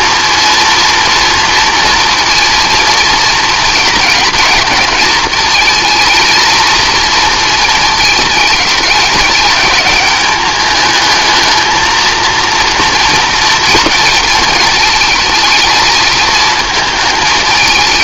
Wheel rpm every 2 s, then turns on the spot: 230, 230, 230, 230, 200, 210, 230, 220, 220.
none